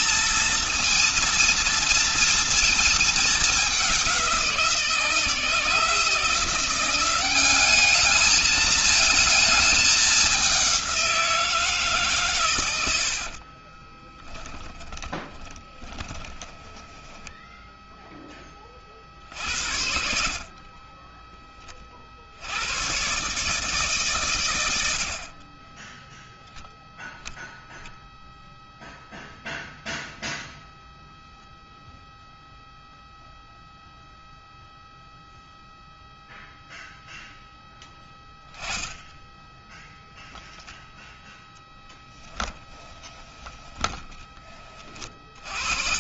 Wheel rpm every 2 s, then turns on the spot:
230, 210, 170, 190, 220, 180, 70, 20, 10, 50, 20, 120, 50, 0, 0, 0, 0, 0, 0, 10, 0, 20, 30.
12-18 42-44